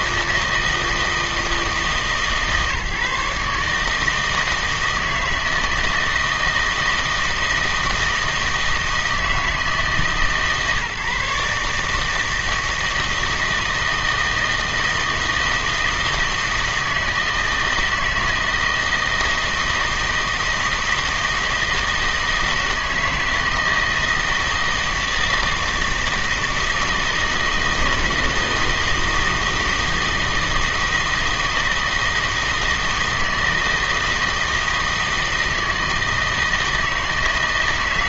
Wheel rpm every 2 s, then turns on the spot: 160, 150, 160, 160, 160, 150, 160, 160, 160, 160, 160, 160, 160, 160, 160, 160, 160, 160, 160.
none